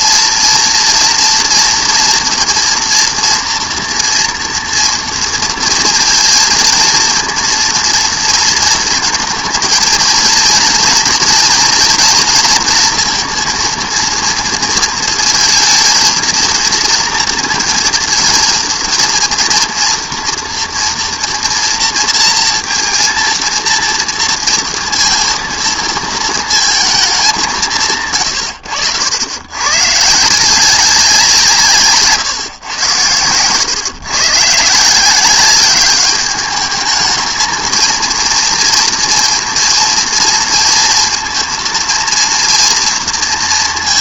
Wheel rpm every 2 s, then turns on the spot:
230, 230, 230, 230, 230, 230, 230, 230, 230, 230, 230, 230, 230, 220, 90, 180, 120, 150, 210, 230, 230, 230.
none